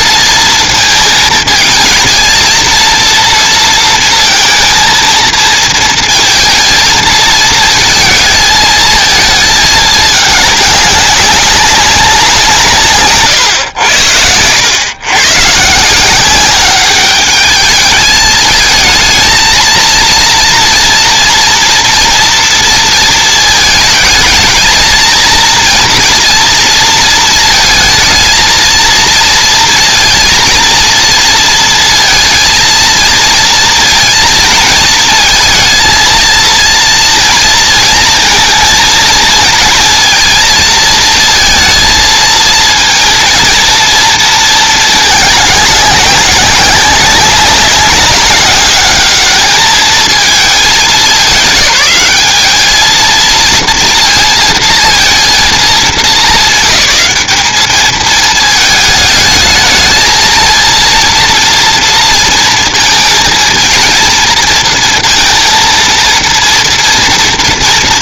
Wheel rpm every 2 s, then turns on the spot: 230, 230, 230, 230, 220, 210, 170, 100, 190, 220, 230, 230, 220, 230, 230, 230, 230, 230, 230, 230, 230, 230, 220, 200, 200, 200, 210, 230, 190, 220, 230, 230, 230, 230.
none